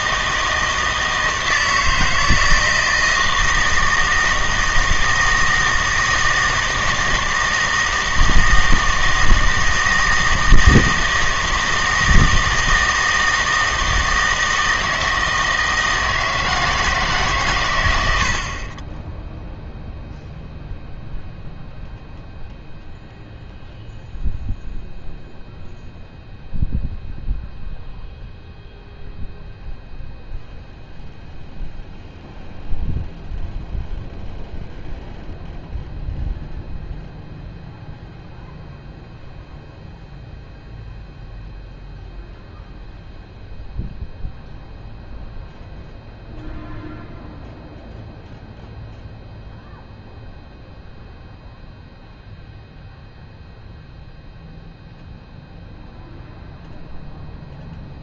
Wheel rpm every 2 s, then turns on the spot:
160, 160, 160, 160, 160, 160, 160, 160, 160, 30, 0, 0, 0, 0, 0, 0, 0, 0, 0, 0, 0, 0, 0, 0, 0, 0, 0, 0, 0.
none